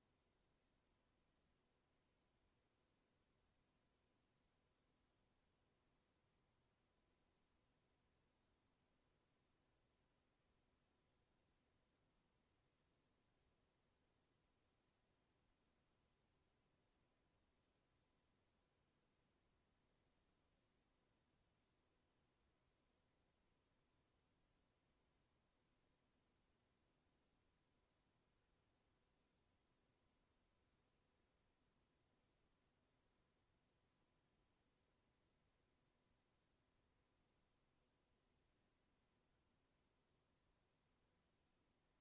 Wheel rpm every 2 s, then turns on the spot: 0, 0, 0, 0, 0, 0, 0, 0, 0, 0, 0, 0, 0, 0, 0, 0, 0, 0, 0, 0, 0.
none